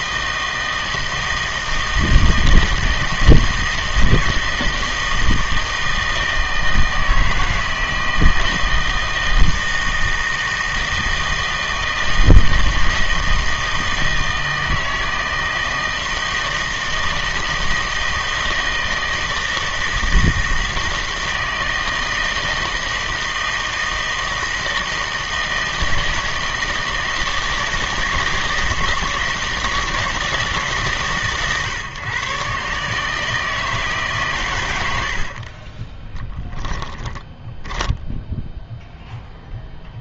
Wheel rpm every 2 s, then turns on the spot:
160, 160, 160, 160, 160, 160, 160, 160, 160, 160, 160, 160, 160, 160, 160, 150, 140, 100, 10, 0.
36-38